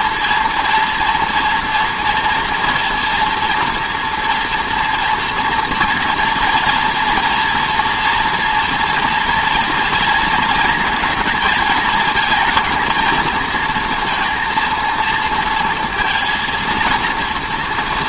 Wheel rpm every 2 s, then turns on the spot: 230, 230, 240, 230, 230, 230, 240, 230, 230.
none